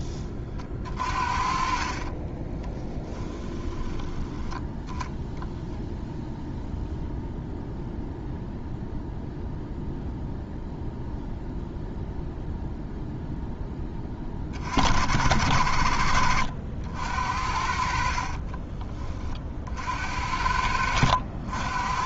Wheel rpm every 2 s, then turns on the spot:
30, 10, 10, 0, 0, 0, 0, 50, 70, 30, 70.
2-4 18-22